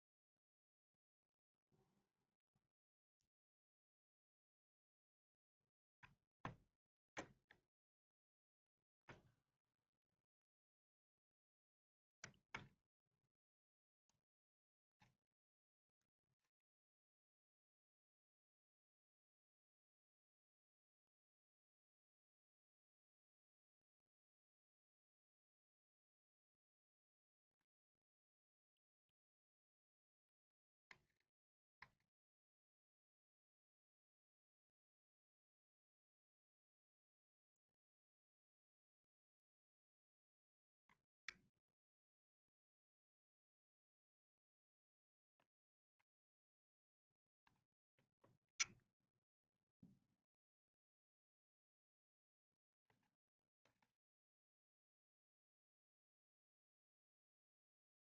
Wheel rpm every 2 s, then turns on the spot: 0, 0, 0, 0, 0, 0, 0, 0, 0, 0, 0, 0, 0, 0, 0, 0, 0, 0, 0, 0, 0, 0, 0, 0, 0, 0, 0, 0, 0.
none